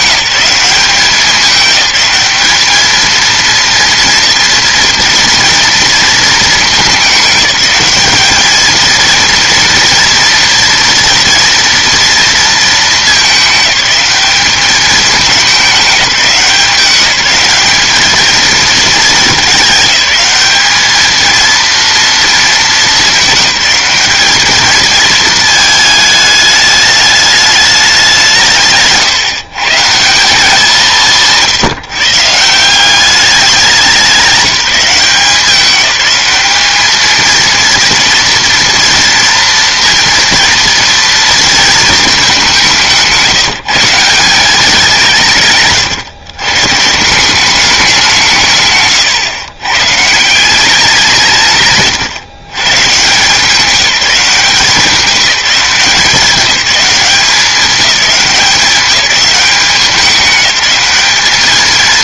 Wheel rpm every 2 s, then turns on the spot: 190, 210, 230, 210, 220, 240, 220, 210, 190, 220, 210, 220, 220, 210, 160, 180, 170, 190, 210, 230, 230, 190, 190, 140, 130, 180, 130, 180, 200, 200, 190.
none